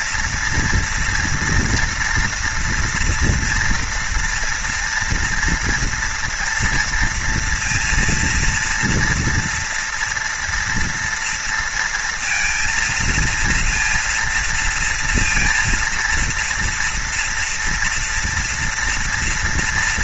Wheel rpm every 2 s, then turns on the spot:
230, 230, 230, 230, 240, 230, 230, 230, 240, 230.
none